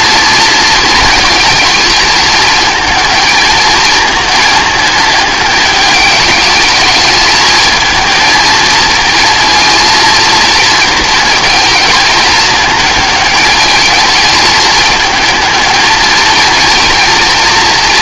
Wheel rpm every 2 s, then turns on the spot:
230, 220, 220, 210, 230, 220, 220, 220, 230.
none